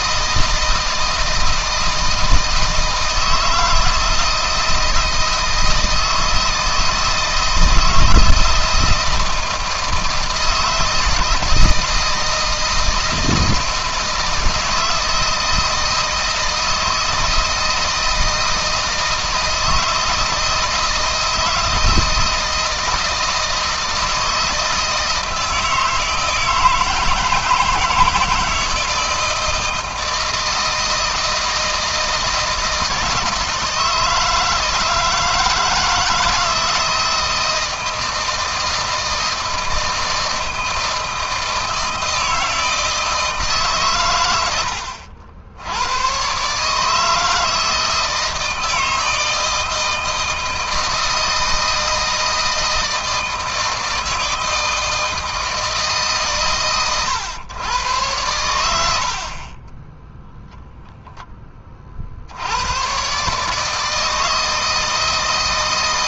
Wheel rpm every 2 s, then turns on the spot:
160, 160, 160, 160, 160, 160, 160, 170, 160, 160, 160, 160, 160, 160, 160, 160, 160, 160, 160, 160, 160, 160, 90, 140, 160, 160, 160, 160, 120, 70, 10, 110, 160.
none